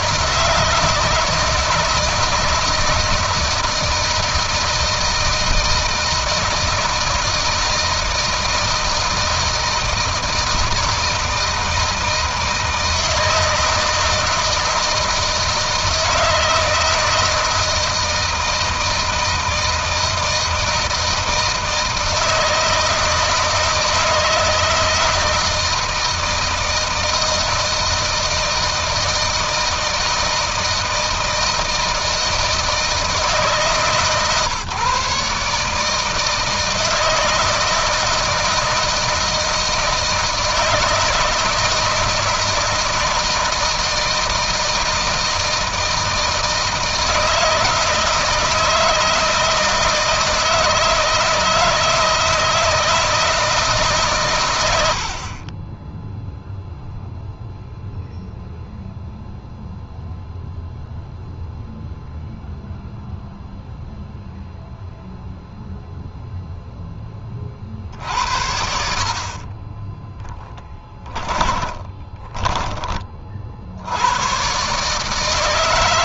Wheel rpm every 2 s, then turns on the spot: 160, 160, 160, 160, 160, 160, 160, 160, 160, 160, 160, 160, 160, 160, 160, 160, 160, 140, 160, 160, 160, 160, 160, 160, 160, 160, 160, 100, 0, 0, 0, 0, 0, 0, 60, 20, 30, 140.
70-72